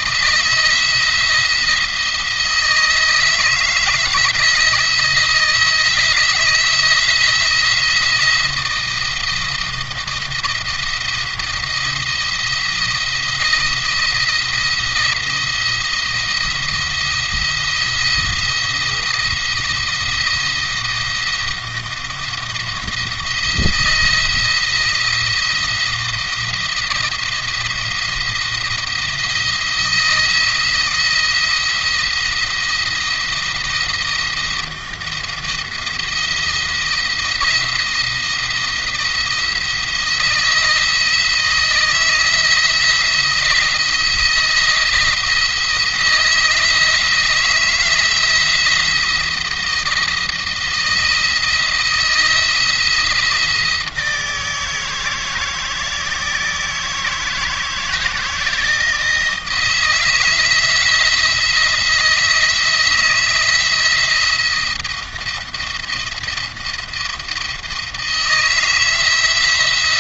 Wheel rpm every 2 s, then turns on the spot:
170, 160, 160, 170, 170, 170, 170, 170, 170, 170, 170, 170, 160, 170, 170, 170, 170, 170, 170, 170, 170, 170, 170, 160, 160, 160, 170, 160, 160, 160, 160, 160, 170, 170, 170.
none